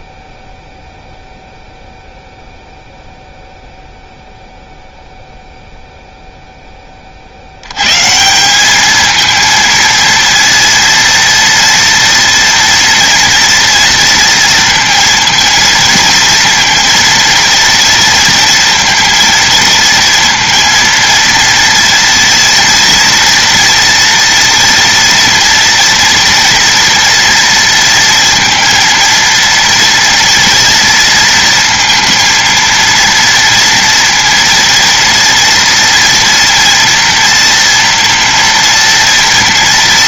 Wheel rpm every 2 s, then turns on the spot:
0, 0, 0, 20, 210, 230, 230, 230, 230, 230, 230, 230, 240, 230, 230, 230, 230, 230, 240, 240.
none